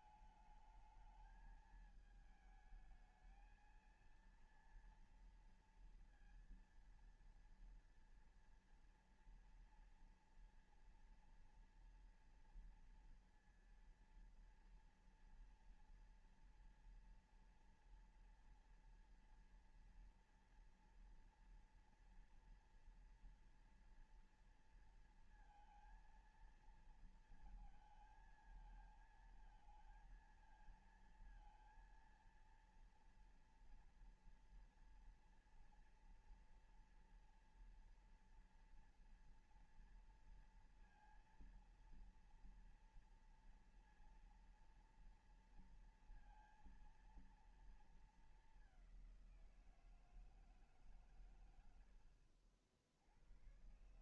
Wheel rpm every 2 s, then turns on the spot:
210, 220, 230, 230, 230, 230, 230, 230, 230, 240, 240, 230, 230, 230, 220, 230, 230, 230, 230, 230, 230, 230, 230, 230, 210, 160, 70.
none